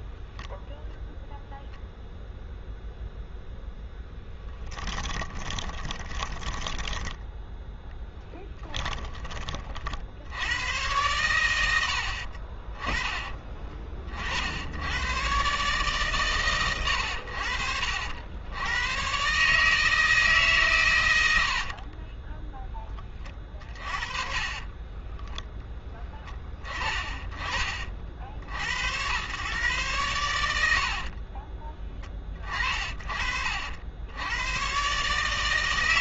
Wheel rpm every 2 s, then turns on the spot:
0, 0, 10, 10, 10, 100, 40, 70, 100, 100, 130, 10, 30, 30, 90, 70, 40, 120.
4-10 12-14 24-26